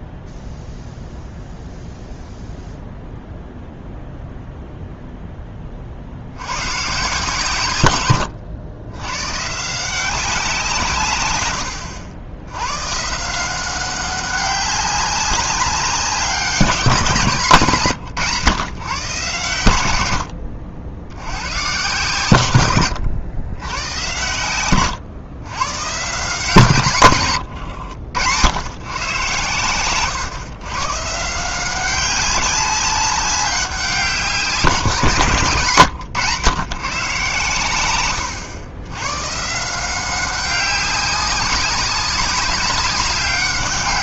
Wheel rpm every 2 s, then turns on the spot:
0, 0, 0, 100, 100, 170, 100, 200, 190, 140, 80, 110, 110, 140, 110, 130, 200, 170, 140, 110, 190, 190.
20-22